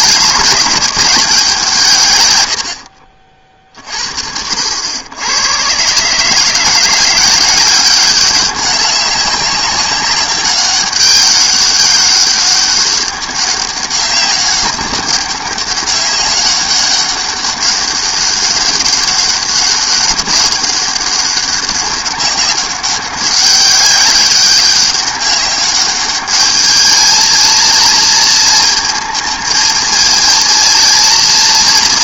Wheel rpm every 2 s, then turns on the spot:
200, 90, 70, 170, 200, 200, 200, 200, 200, 200, 200, 190, 200, 210, 220, 230.
none